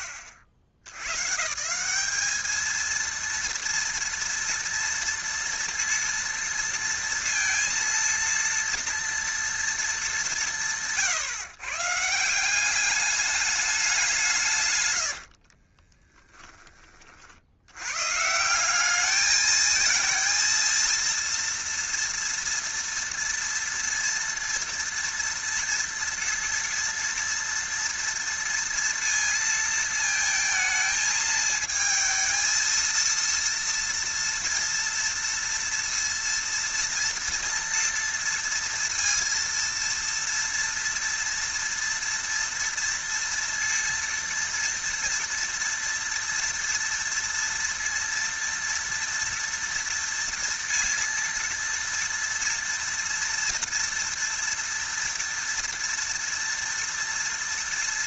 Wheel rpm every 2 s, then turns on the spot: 70, 230, 230, 230, 230, 150, 200, 100, 30, 210, 230, 230, 230, 230, 230, 220, 230, 230, 230, 230, 230, 230, 230, 230, 230, 230, 230, 230, 230.
none